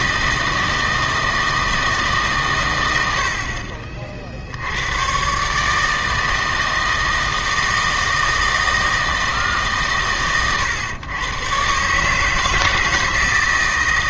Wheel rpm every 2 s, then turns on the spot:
160, 110, 90, 160, 160, 110, 160.
none